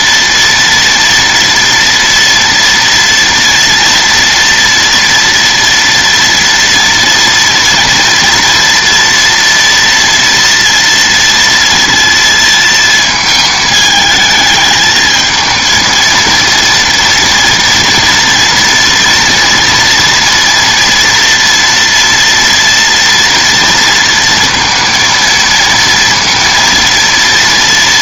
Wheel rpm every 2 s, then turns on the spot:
230, 230, 230, 230, 240, 230, 230, 220, 230, 230, 230, 230, 230, 230.
none